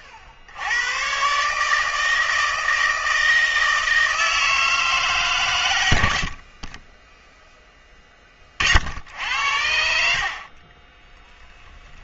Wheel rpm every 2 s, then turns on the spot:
70, 160, 160, 40, 40, 30.
none